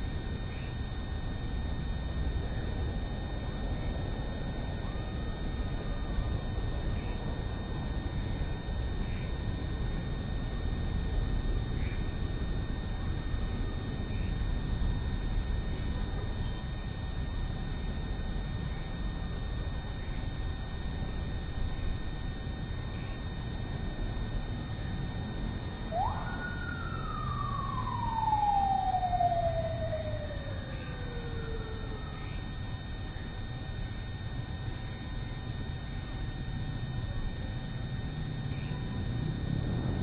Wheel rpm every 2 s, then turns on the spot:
0, 0, 0, 0, 0, 0, 0, 0, 0, 0, 0, 0, 0, 0, 0, 0, 0, 0, 0, 0.
none